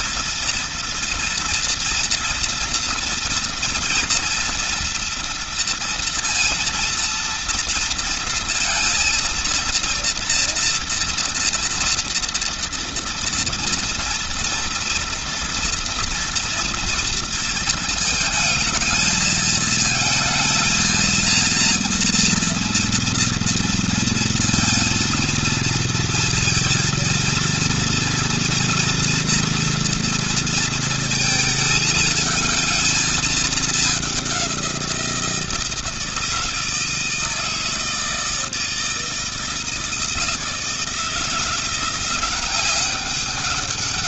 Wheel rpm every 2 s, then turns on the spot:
230, 230, 230, 230, 230, 230, 230, 230, 230, 220, 230, 230, 230, 230, 230, 230, 220, 190, 160, 160, 160, 190.
none